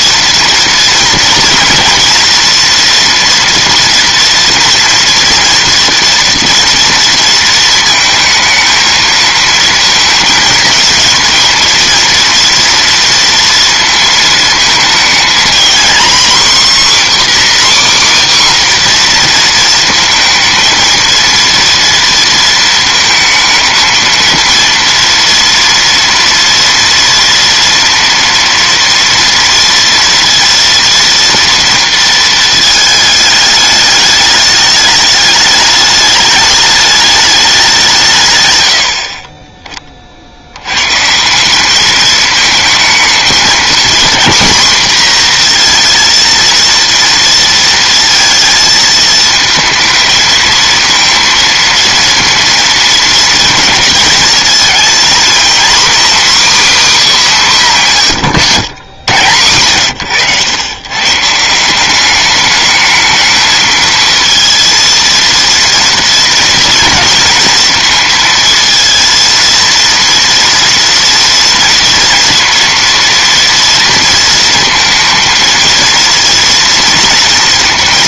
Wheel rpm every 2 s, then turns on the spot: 230, 240, 230, 230, 220, 230, 230, 230, 270, 260, 230, 230, 230, 230, 230, 230, 220, 210, 210, 90, 130, 220, 240, 230, 230, 230, 230, 230, 270, 110, 120, 220, 230, 230, 230, 230, 240, 230, 230.
none